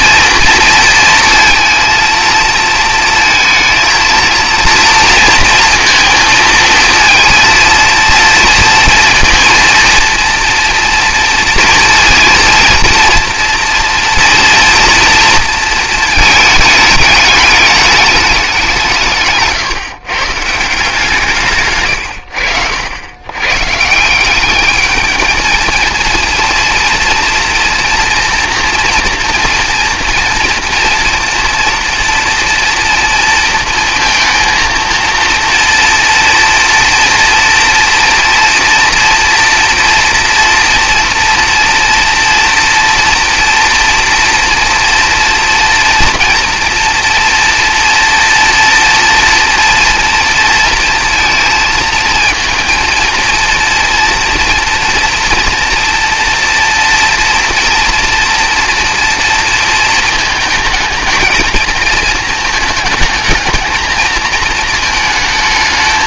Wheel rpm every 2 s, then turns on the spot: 230, 230, 230, 230, 230, 230, 230, 230, 210, 160, 160, 90, 210, 230, 230, 230, 230, 230, 230, 230, 230, 230, 230, 230, 230, 230, 230, 230, 230, 240, 220, 220, 220.
none